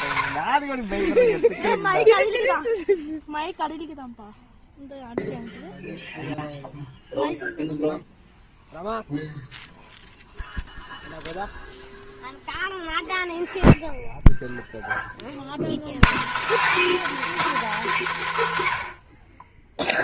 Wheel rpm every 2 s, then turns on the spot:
0, 0, 0, 0, 0, 0, 0, 140, 310, 10.
none